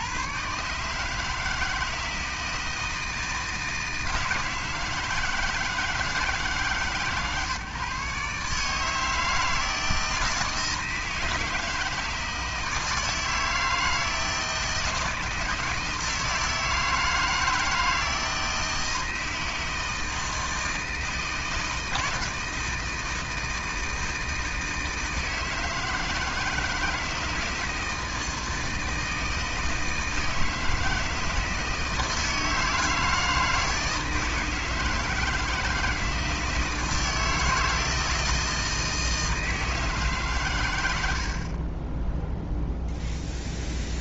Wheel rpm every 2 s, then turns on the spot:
90, 160, 160, 150, 140, 160, 160, 160, 160, 160, 160, 160, 160, 160, 160, 160, 160, 160, 160, 160, 130, 0.
none